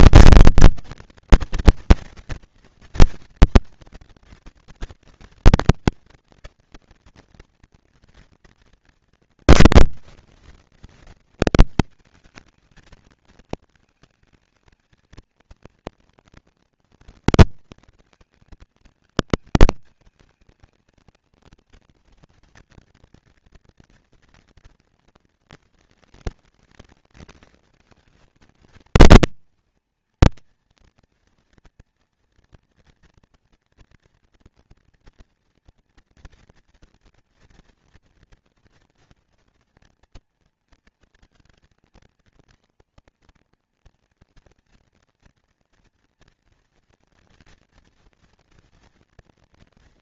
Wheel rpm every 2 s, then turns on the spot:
230, 230, 240, 230, 220, 180, 220, 220, 230, 230, 220, 230, 230, 230, 230, 240, 230, 230, 230, 230, 230, 240, 230, 230, 240.
none